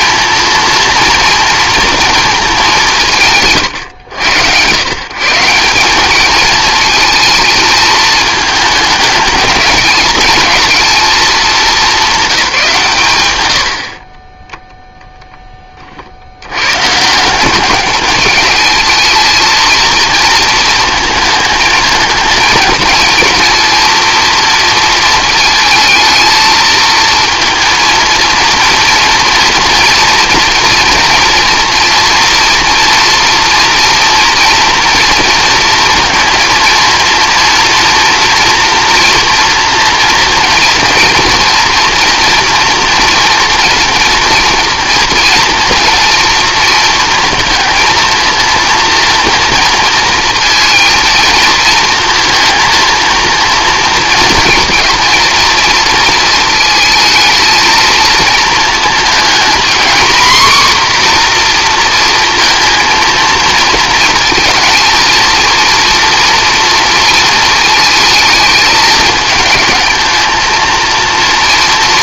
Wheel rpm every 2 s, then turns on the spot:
220, 200, 120, 220, 210, 220, 170, 10, 110, 220, 230, 220, 230, 230, 230, 230, 230, 230, 230, 240, 230, 240, 230, 230, 230, 230, 230, 240, 230, 220, 250, 230, 230, 230, 220, 230.
none